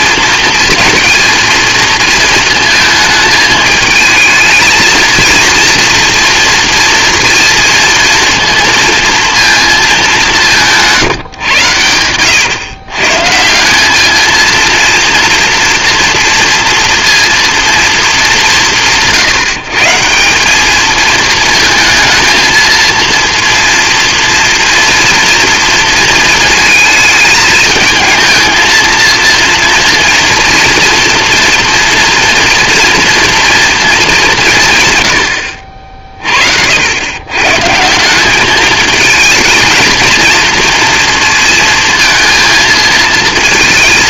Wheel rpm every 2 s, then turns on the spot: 230, 220, 220, 230, 230, 170, 120, 230, 230, 180, 200, 230, 230, 220, 230, 230, 230, 150, 70, 220, 230, 230.
none